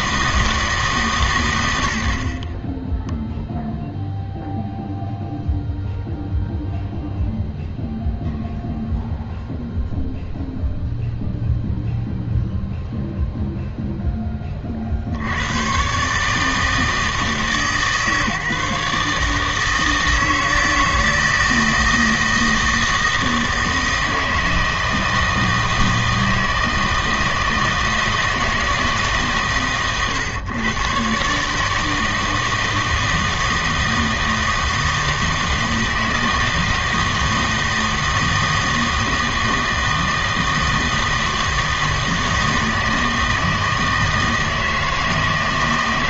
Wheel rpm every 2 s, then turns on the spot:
150, 20, 0, 0, 0, 0, 0, 40, 160, 150, 160, 160, 160, 160, 160, 130, 160, 160, 160, 160, 160, 160, 160.
none